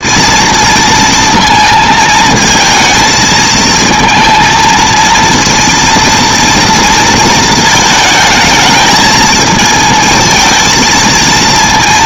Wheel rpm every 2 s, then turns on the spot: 230, 220, 230, 230, 210, 220.
none